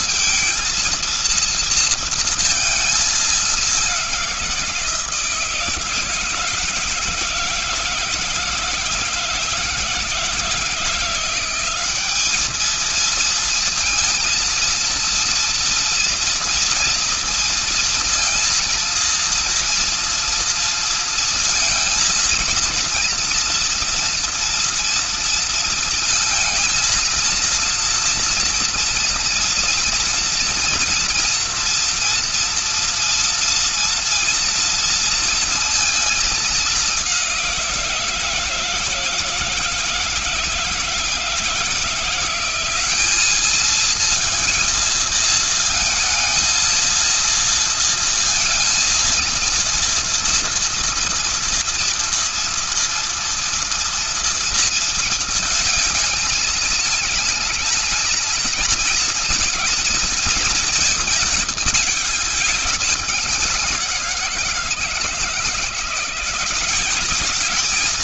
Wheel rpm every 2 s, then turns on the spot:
230, 220, 170, 160, 160, 170, 220, 230, 230, 230, 230, 230, 230, 220, 230, 230, 240, 230, 200, 160, 160, 210, 230, 230, 230, 230, 230, 230, 220, 230, 220, 200, 160, 190.
none